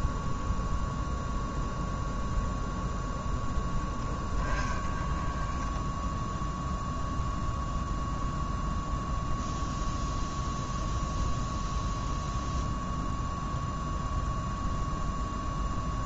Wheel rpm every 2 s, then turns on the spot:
0, 0, 10, 0, 0, 0, 0, 0.
none